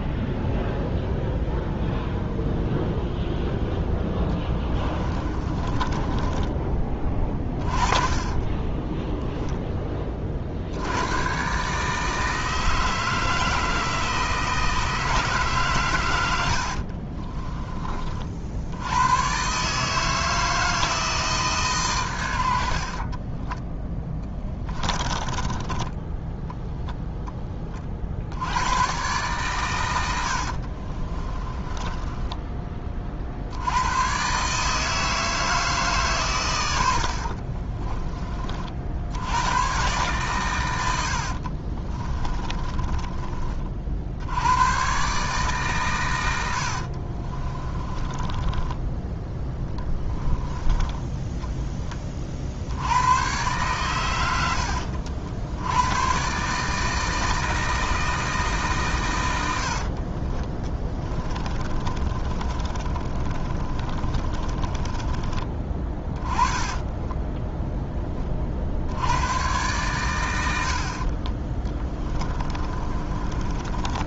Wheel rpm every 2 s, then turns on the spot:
0, 0, 20, 20, 10, 90, 160, 160, 50, 90, 160, 60, 20, 0, 110, 40, 30, 160, 100, 70, 90, 20, 120, 60, 10, 10, 90, 60, 160, 130, 20, 30, 20, 20, 80, 50, 30.
4-10 16-18 24-26 30-32 36-38 42-44 46-50 60-68 72-74